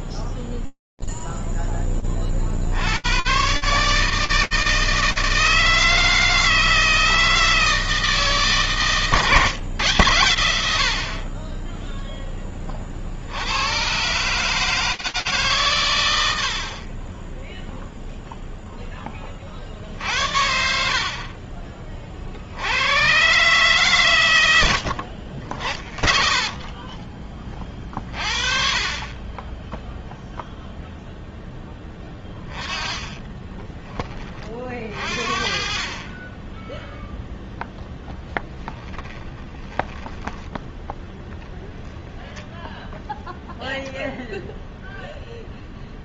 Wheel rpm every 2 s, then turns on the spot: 0, 10, 130, 160, 160, 110, 10, 120, 100, 0, 70, 70, 90, 30, 40, 0, 30, 50, 10, 20, 10, 0, 0.
32-34 38-40